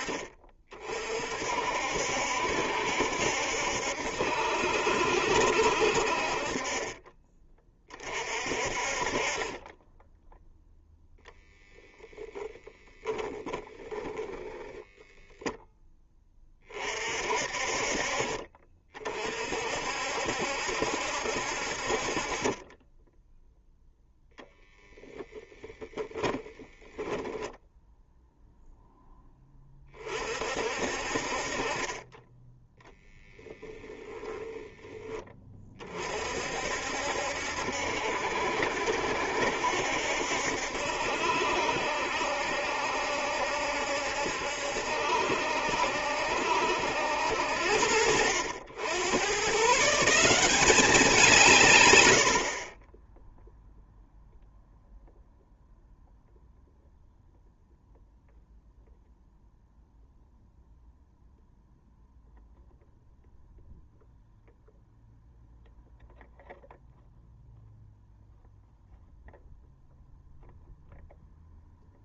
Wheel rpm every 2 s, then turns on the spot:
40, 70, 70, 30, 40, 10, 20, 0, 40, 40, 70, 20, 10, 10, 0, 50, 10, 10, 60, 70, 70, 70, 70, 80, 90, 190, 30, 0, 0, 0, 0, 0, 0, 0, 0, 0.
12-14 24-28